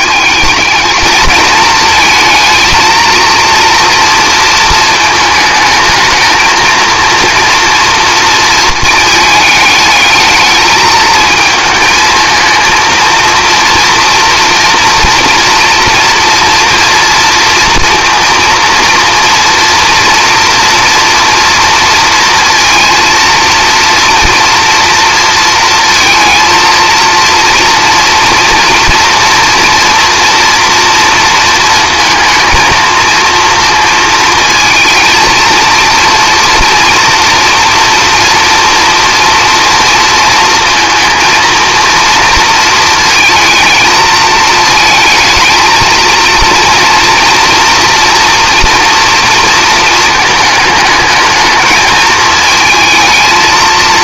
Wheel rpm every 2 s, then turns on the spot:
220, 230, 220, 230, 230, 220, 230, 240, 230, 240, 240, 230, 230, 230, 230, 240, 230, 220, 230, 230, 230, 220, 220, 230, 240, 210, 220.
none